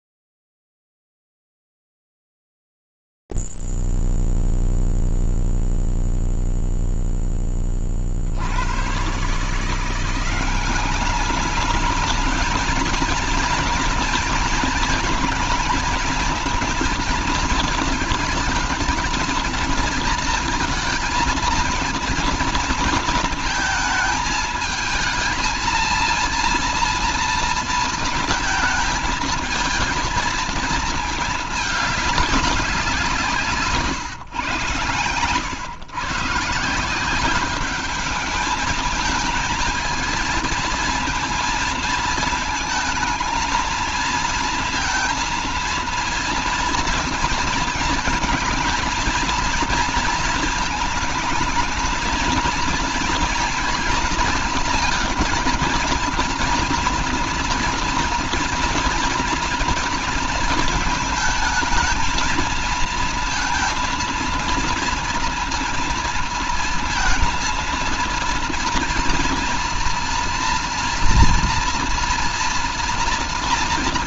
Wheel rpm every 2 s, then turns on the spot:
0, 0, 0, 0, 80, 190, 220, 230, 220, 220, 220, 230, 220, 230, 220, 220, 190, 130, 170, 220, 230, 220, 230, 230, 230, 220, 230, 230, 240, 240, 220, 230, 230, 230, 230, 230, 230.
none